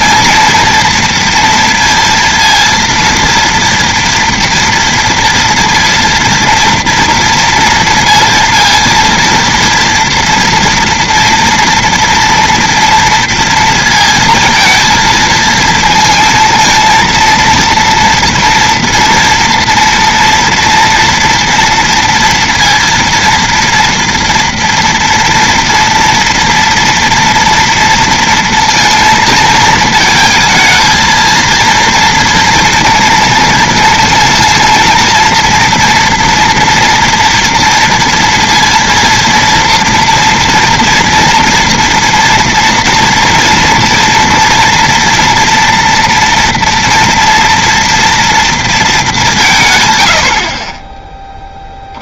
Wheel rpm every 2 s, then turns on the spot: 230, 230, 230, 230, 230, 240, 230, 230, 230, 230, 240, 230, 230, 230, 230, 220, 230, 230, 240, 230, 230, 240, 230, 230, 230, 60.
none